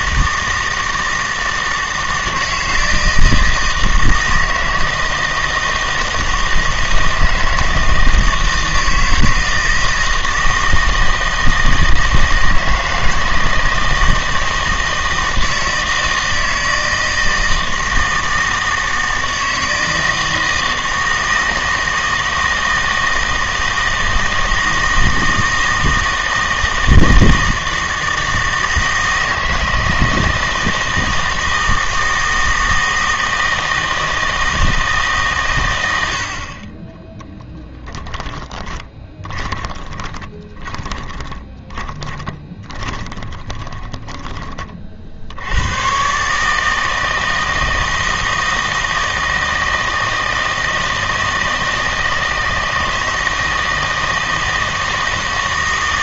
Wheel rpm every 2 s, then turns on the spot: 160, 160, 160, 160, 160, 160, 160, 160, 160, 160, 160, 160, 160, 160, 160, 160, 160, 160, 30, 20, 20, 20, 40, 160, 160, 160, 160, 160.
38-44